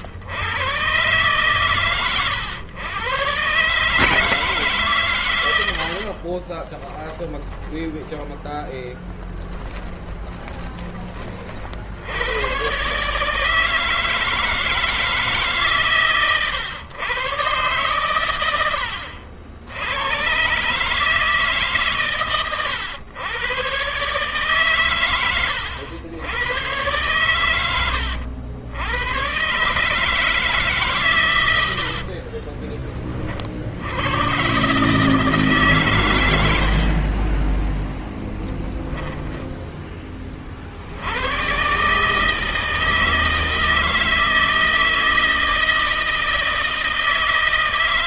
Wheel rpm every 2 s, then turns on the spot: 120, 110, 140, 20, 20, 30, 140, 160, 110, 90, 140, 110, 130, 110, 90, 140, 30, 140, 60, 10, 60, 160, 160, 160.
6-10 18-20 36-40